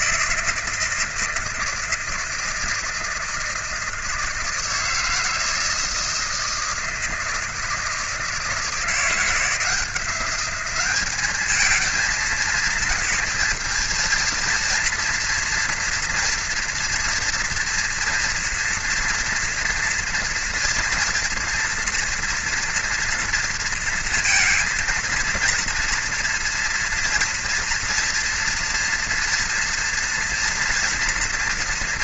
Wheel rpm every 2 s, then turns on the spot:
160, 160, 160, 160, 160, 190, 220, 230, 240, 230, 230, 240, 230, 230, 230, 230.
none